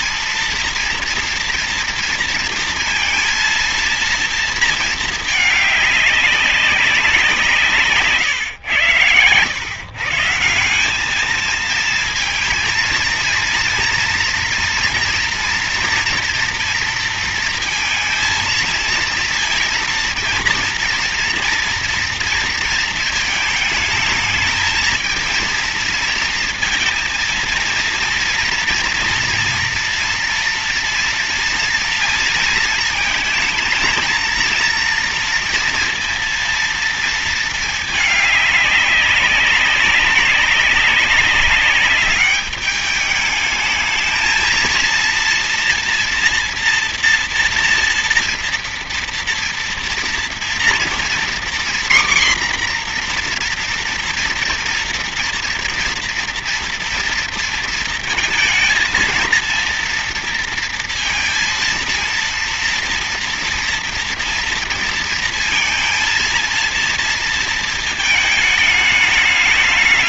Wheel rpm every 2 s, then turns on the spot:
230, 230, 220, 200, 120, 180, 230, 240, 230, 230, 230, 230, 220, 230, 230, 230, 230, 230, 230, 200, 200, 200, 230, 240, 240, 230, 250, 230, 230, 230, 230, 230, 230, 230, 210.
none